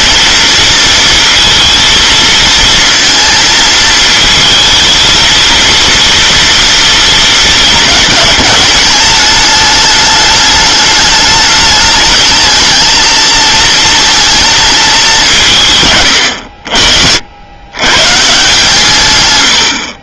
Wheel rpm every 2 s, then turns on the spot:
230, 230, 220, 230, 210, 210, 220, 220, 70, 150.
none